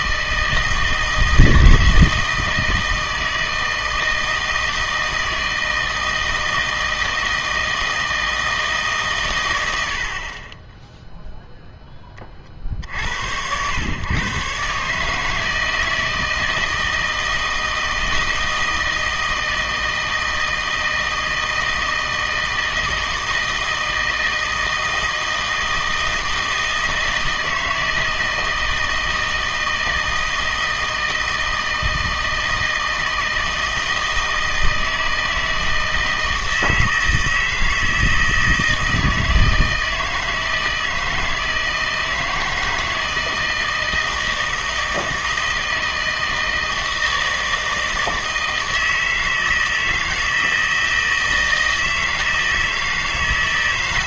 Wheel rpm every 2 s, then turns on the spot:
160, 160, 160, 160, 150, 20, 50, 140, 160, 160, 160, 160, 160, 160, 160, 160, 160, 160, 160, 160, 160, 160, 160, 160, 160, 160, 160.
none